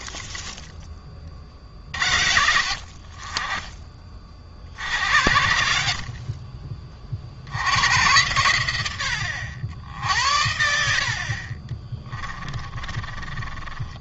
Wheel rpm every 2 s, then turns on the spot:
30, 50, 70, 40, 90, 60, 20.
12-14